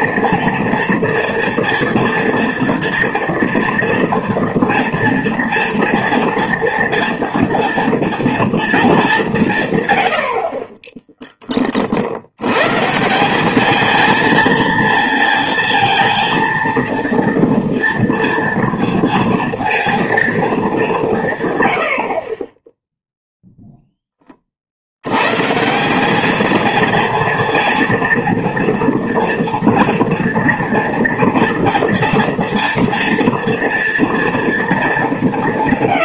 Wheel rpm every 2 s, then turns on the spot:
230, 230, 230, 230, 220, 40, 120, 230, 230, 230, 200, 10, 50, 230, 230, 230, 230, 220.
none